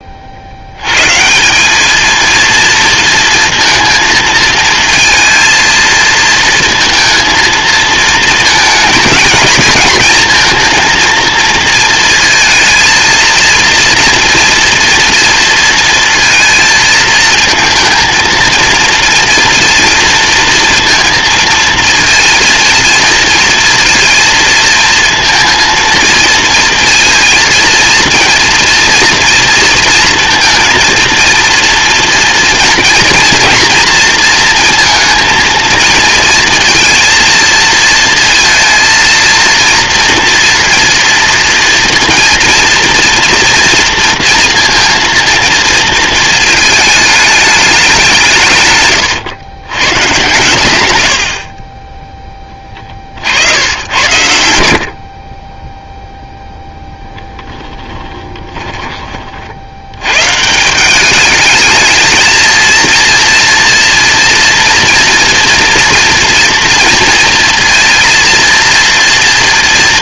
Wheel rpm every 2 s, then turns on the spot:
160, 230, 230, 220, 220, 230, 230, 230, 220, 230, 230, 230, 230, 230, 230, 230, 230, 230, 230, 230, 230, 230, 230, 210, 130, 80, 60, 60, 0, 30, 200, 230, 230, 230, 230.
none